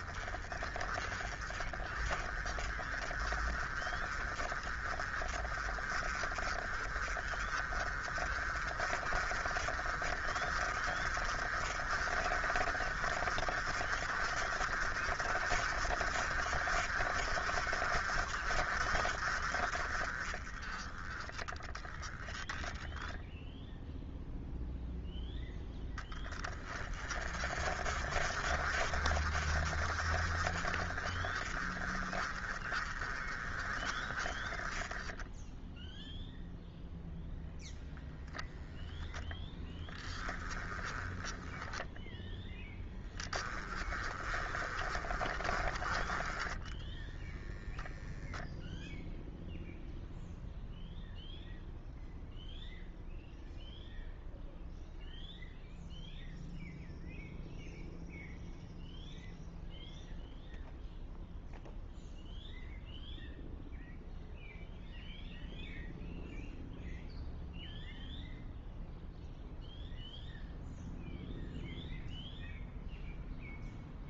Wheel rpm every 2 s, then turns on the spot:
20, 30, 30, 30, 40, 40, 40, 50, 50, 50, 20, 0, 0, 20, 50, 40, 30, 20, 0, 0, 10, 10, 30, 10, 0, 0, 0, 0, 0, 0, 0, 0, 0, 0, 0, 0, 0.
none